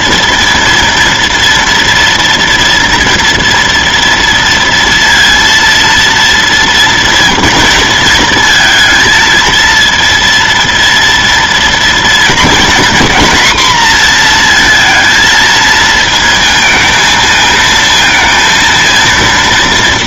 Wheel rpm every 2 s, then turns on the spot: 230, 230, 230, 230, 230, 230, 240, 230, 220, 230.
none